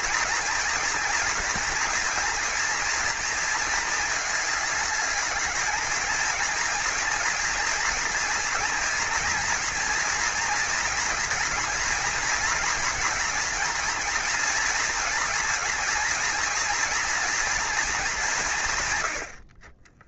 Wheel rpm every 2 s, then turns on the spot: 230, 230, 210, 230, 230, 230, 230, 240, 240, 140.
none